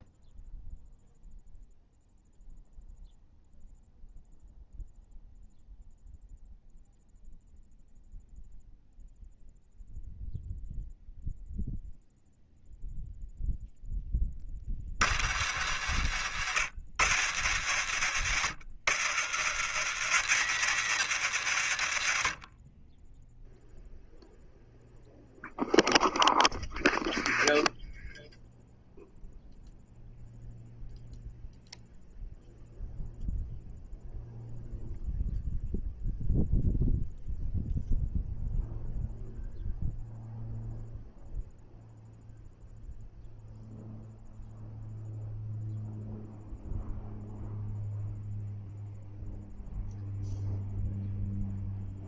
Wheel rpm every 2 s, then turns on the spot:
0, 0, 0, 0, 0, 0, 0, 50, 70, 70, 100, 10, 0, 0, 0, 0, 0, 0, 0, 0, 0, 0, 0, 0, 0, 0.
none